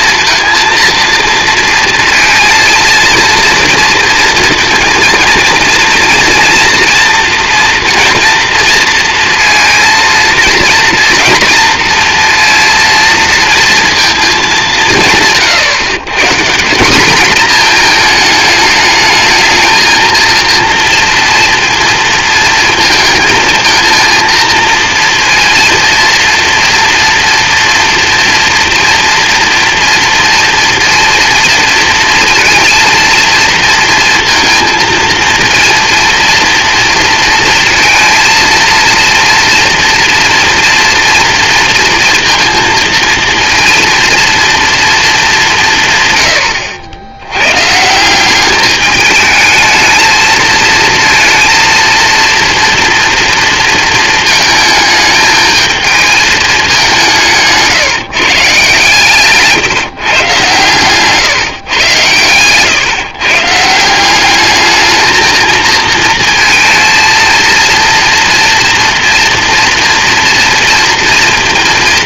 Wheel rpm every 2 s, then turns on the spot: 230, 230, 230, 230, 230, 230, 230, 230, 150, 230, 220, 230, 230, 230, 230, 240, 230, 230, 230, 230, 230, 230, 230, 140, 160, 220, 230, 230, 220, 150, 140, 120, 180, 230, 230, 230.
none